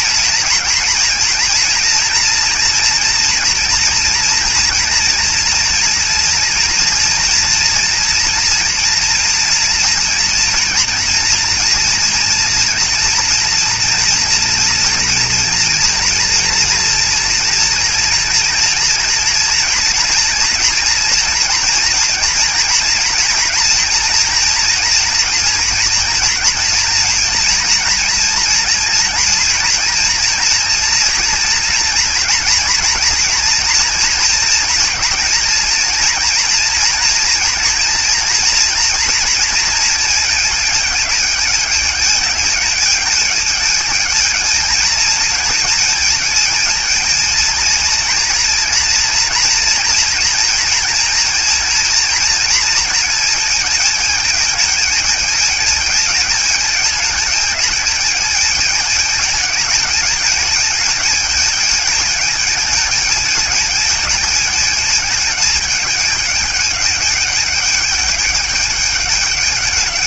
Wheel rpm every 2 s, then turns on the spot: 230, 230, 230, 240, 240, 240, 240, 230, 240, 230, 240, 240, 230, 230, 230, 240, 230, 240, 230, 240, 230, 210, 220, 220, 230, 230, 230, 210, 220, 220, 220, 210, 210, 210, 210.
none